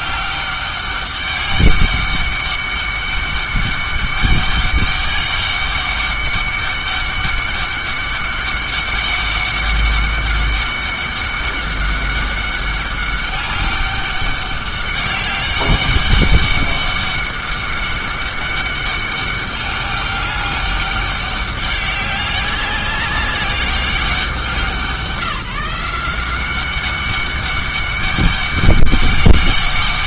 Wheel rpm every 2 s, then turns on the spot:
200, 200, 200, 200, 200, 200, 200, 200, 200, 200, 200, 200, 170, 190, 200.
none